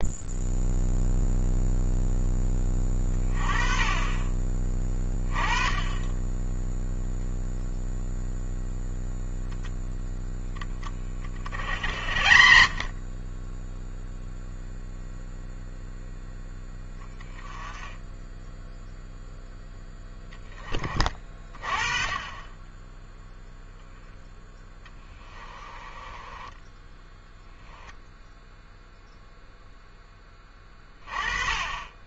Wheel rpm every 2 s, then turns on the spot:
0, 20, 20, 0, 0, 20, 40, 0, 10, 0, 20, 10, 10, 10, 0, 20.
24-28